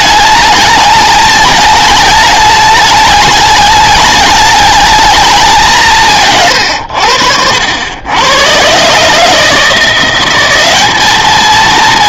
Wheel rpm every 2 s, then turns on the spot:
210, 210, 210, 120, 120, 200.
none